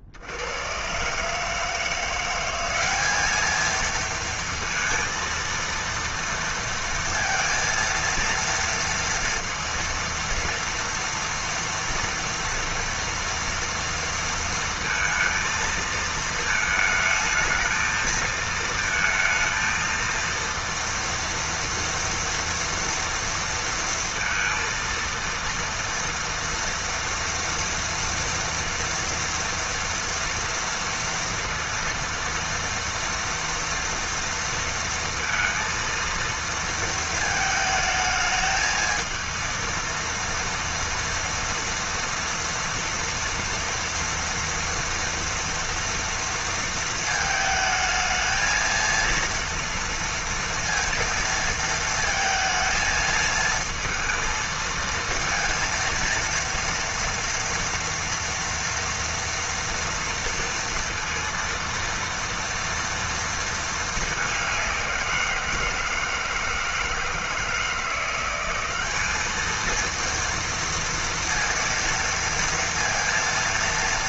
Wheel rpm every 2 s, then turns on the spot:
100, 190, 230, 230, 230, 230, 230, 230, 220, 230, 230, 230, 230, 230, 230, 230, 230, 230, 230, 220, 230, 230, 230, 230, 230, 230, 220, 220, 230, 230, 230, 230, 190, 160, 190, 230, 230.
none